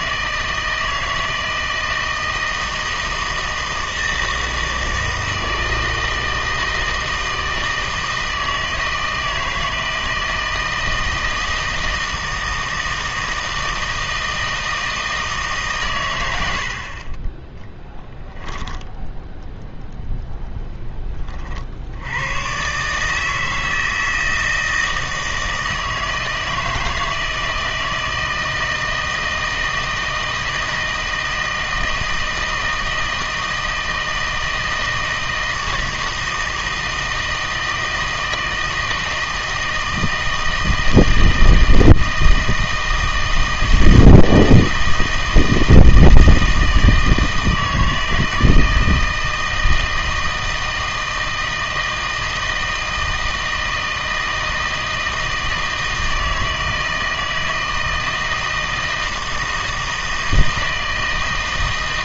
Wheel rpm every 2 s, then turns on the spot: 160, 160, 160, 160, 160, 160, 160, 160, 60, 0, 10, 140, 160, 160, 160, 160, 160, 160, 160, 160, 160, 160, 160, 160, 160, 160, 160, 160, 160, 160, 160.
none